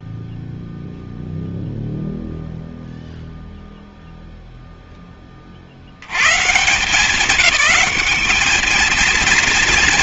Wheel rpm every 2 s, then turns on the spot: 0, 0, 0, 150, 220.
none